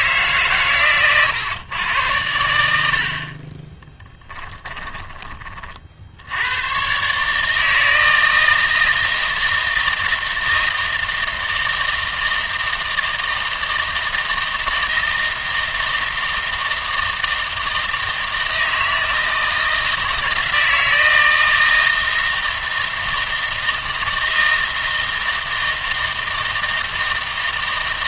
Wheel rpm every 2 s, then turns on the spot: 130, 80, 20, 110, 160, 160, 160, 160, 160, 160, 160, 160, 160, 160.
4-6